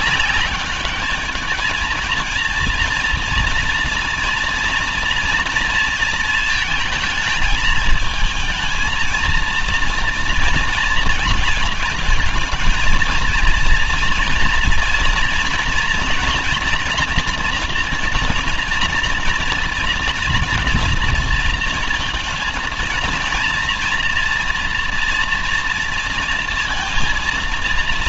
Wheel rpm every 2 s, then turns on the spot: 200, 230, 230, 230, 230, 230, 220, 230, 240, 240, 240, 230, 230, 230.
none